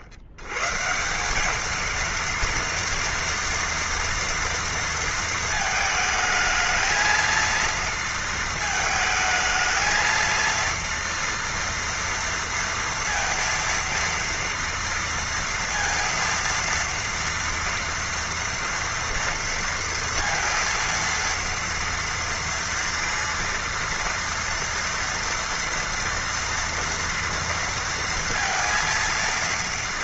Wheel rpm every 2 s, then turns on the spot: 90, 230, 230, 220, 220, 230, 230, 230, 230, 230, 230, 230, 230, 230, 230.
none